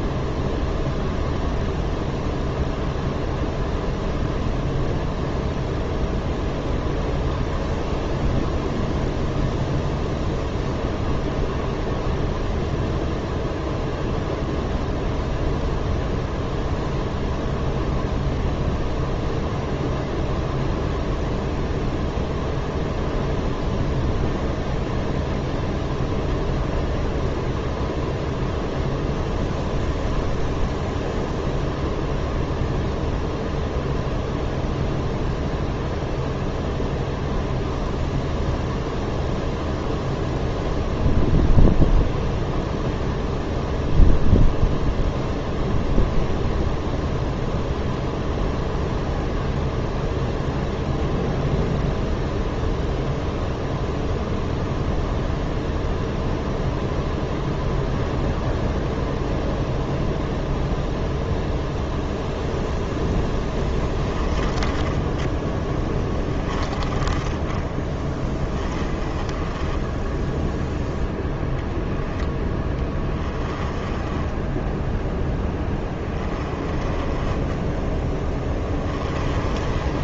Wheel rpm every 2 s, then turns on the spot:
0, 0, 0, 0, 0, 0, 0, 0, 0, 0, 0, 0, 0, 0, 0, 0, 0, 0, 0, 0, 0, 0, 0, 0, 0, 0, 0, 0, 0, 0, 0, 0, 10, 20, 20, 0, 10, 10, 20, 20.
64-70 72-74 76-80